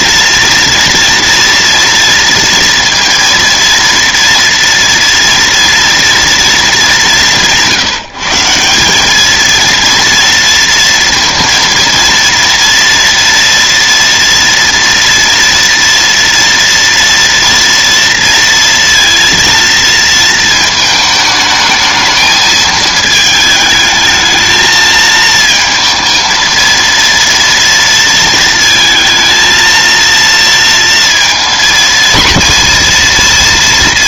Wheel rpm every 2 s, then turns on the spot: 230, 230, 230, 200, 200, 230, 230, 230, 230, 230, 220, 220, 220, 230, 230, 230, 240.
none